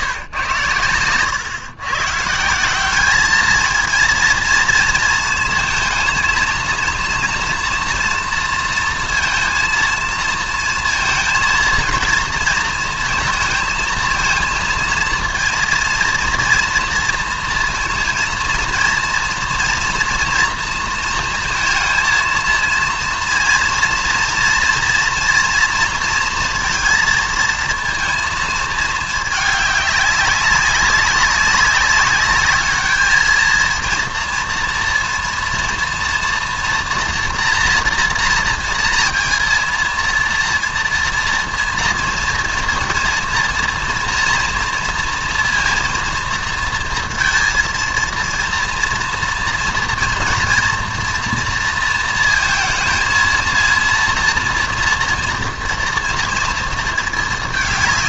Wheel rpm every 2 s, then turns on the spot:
110, 180, 230, 230, 230, 230, 230, 230, 240, 230, 230, 230, 230, 230, 220, 200, 210, 230, 230, 230, 230, 230, 230, 230, 230, 230, 220, 240, 230.
none